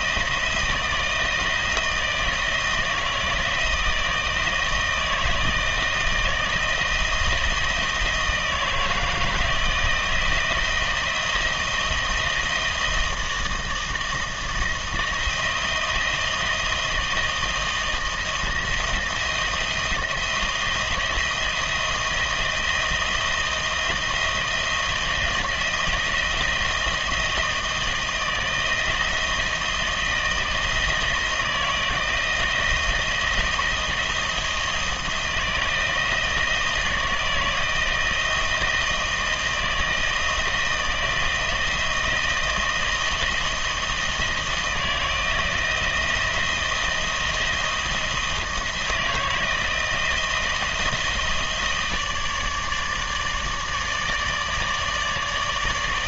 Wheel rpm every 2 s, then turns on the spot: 160, 160, 160, 170, 160, 160, 160, 170, 160, 160, 170, 170, 160, 160, 160, 160, 160, 160, 160, 160, 160, 160, 160, 170, 160, 160, 150, 150.
none